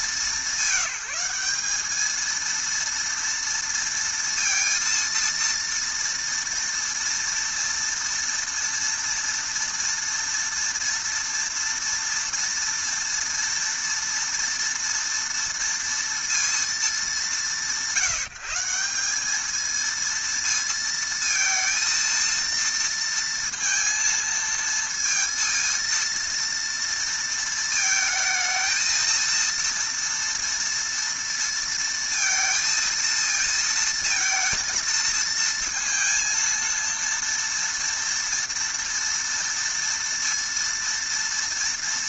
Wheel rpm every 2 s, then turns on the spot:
190, 230, 230, 230, 230, 230, 230, 230, 220, 180, 230, 230, 230, 230, 220, 230, 230, 220, 230, 230, 230.
none